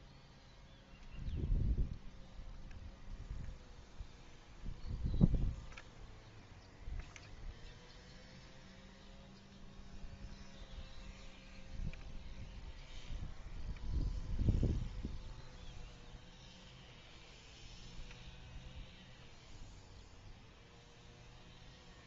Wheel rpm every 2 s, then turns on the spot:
0, 0, 0, 0, 0, 0, 0, 0, 0, 0, 0.
none